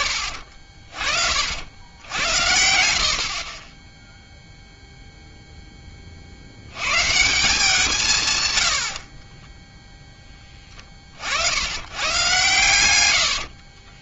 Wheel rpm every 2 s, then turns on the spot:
30, 80, 0, 90, 110, 20, 120.
none